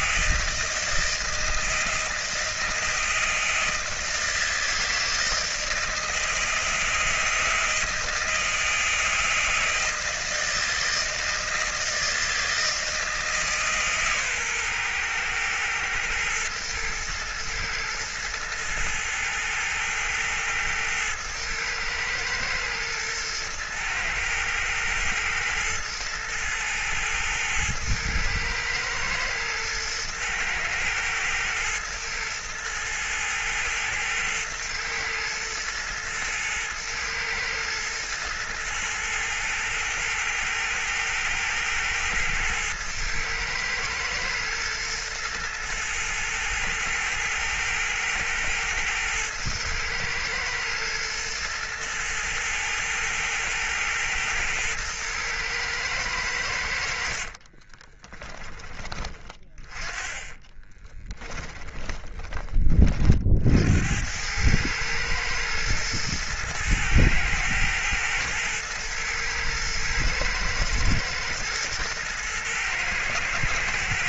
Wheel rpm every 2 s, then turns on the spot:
160, 160, 160, 160, 160, 160, 160, 120, 110, 110, 110, 110, 110, 110, 110, 110, 110, 110, 110, 120, 110, 110, 110, 110, 110, 120, 110, 110, 60, 20, 20, 40, 110, 110, 120, 110, 110.
56-58 60-62